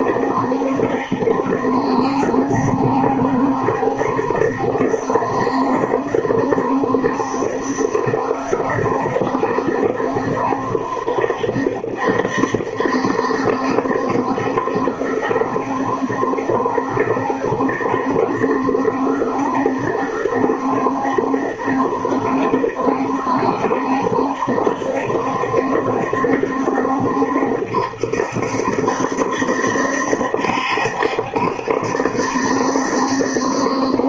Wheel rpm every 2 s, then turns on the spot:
70, 70, 70, 70, 70, 70, 70, 70, 70, 70, 70, 70, 70, 70, 70, 70, 70.
none